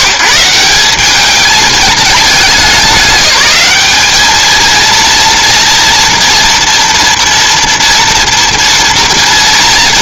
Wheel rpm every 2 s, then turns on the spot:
150, 210, 220, 230, 230.
none